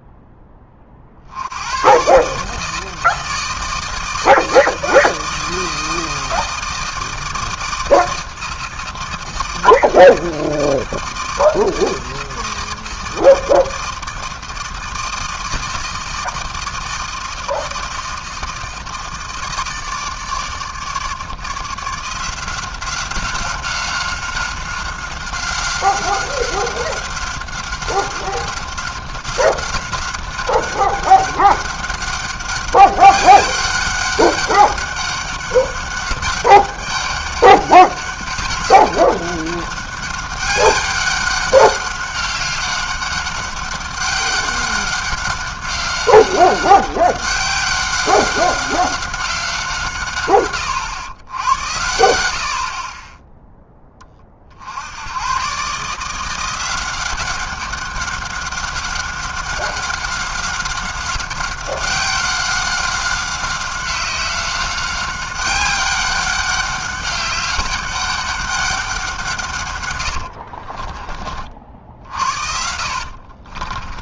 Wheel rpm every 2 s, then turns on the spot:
20, 150, 160, 160, 160, 160, 160, 160, 160, 160, 150, 180, 190, 190, 190, 190, 200, 200, 200, 200, 200, 190, 190, 190, 190, 130, 70, 50, 170, 190, 190, 190, 190, 200, 200, 60, 60.
70-74